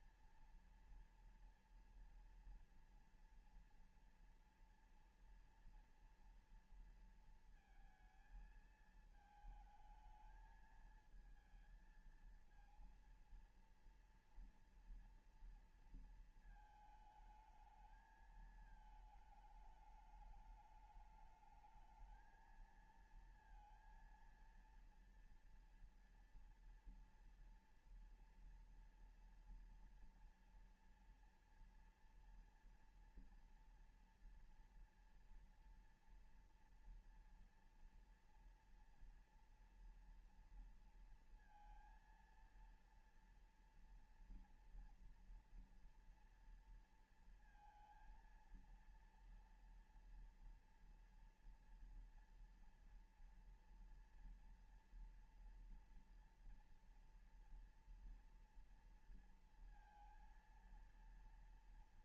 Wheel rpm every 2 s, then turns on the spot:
230, 230, 230, 230, 220, 220, 230, 240, 230, 220, 210, 220, 230, 230, 230, 230, 240, 230, 230, 240, 230, 230, 230, 230, 230, 230, 230, 230, 230, 230, 230.
none